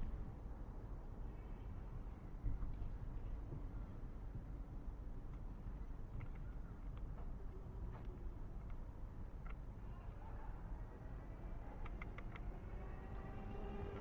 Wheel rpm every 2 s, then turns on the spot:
0, 0, 0, 0, 0, 0, 0.
none